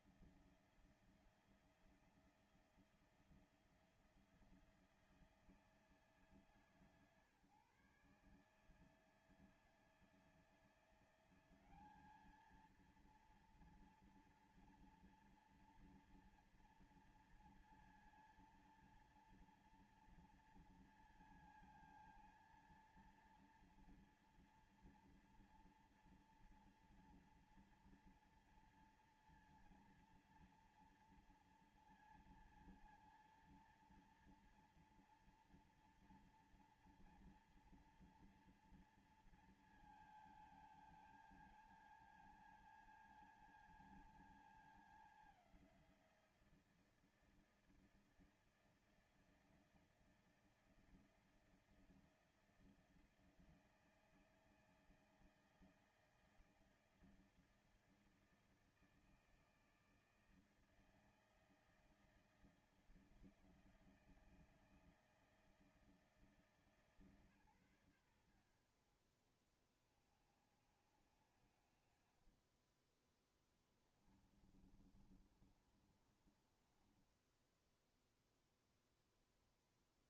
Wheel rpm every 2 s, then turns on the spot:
160, 170, 170, 160, 150, 160, 190, 230, 230, 230, 230, 230, 230, 230, 230, 230, 230, 230, 230, 230, 230, 220, 220, 190, 160, 160, 160, 160, 160, 160, 160, 160, 160, 160, 130, 50, 50, 10, 30, 10.
74-80